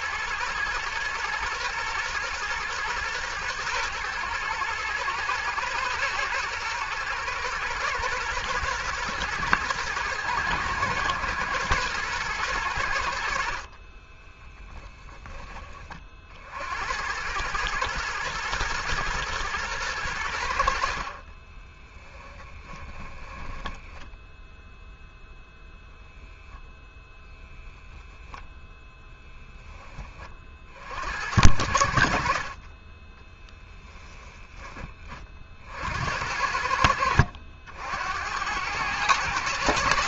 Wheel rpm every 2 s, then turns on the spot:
110, 120, 110, 110, 120, 110, 100, 10, 70, 120, 70, 20, 10, 10, 0, 50, 50, 20, 80, 90.
22-24